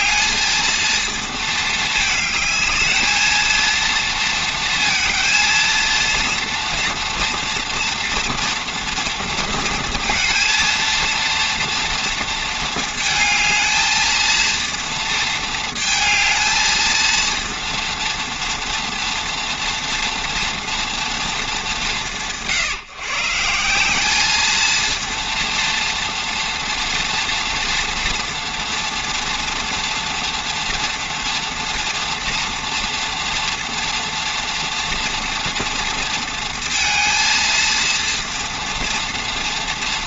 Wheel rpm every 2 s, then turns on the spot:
220, 220, 230, 230, 230, 230, 220, 230, 220, 230, 230, 140, 220, 230, 230, 240, 230, 240, 230, 230.
none